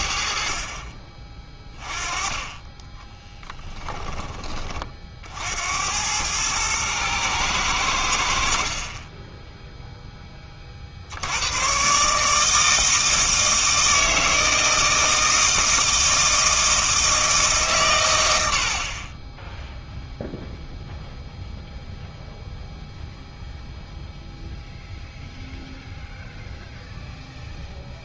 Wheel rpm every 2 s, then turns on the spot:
40, 20, 30, 110, 60, 40, 160, 160, 160, 60, 0, 0, 0, 0.
none